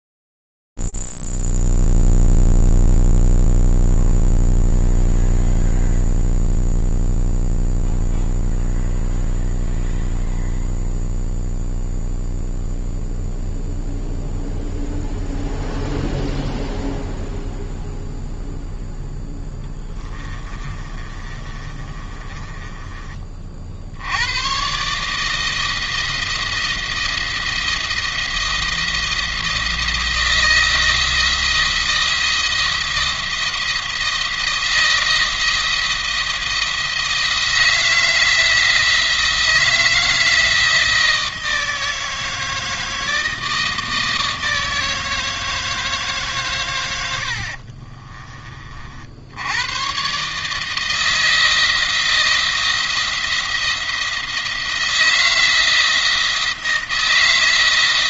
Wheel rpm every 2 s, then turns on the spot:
0, 0, 0, 0, 0, 0, 0, 0, 0, 0, 30, 30, 140, 170, 170, 160, 170, 170, 170, 170, 160, 160, 160, 110, 60, 160, 170, 170, 170.
20-22